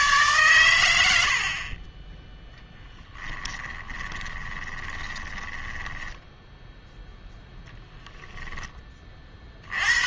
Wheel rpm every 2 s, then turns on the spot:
110, 0, 20, 10, 20.
4-6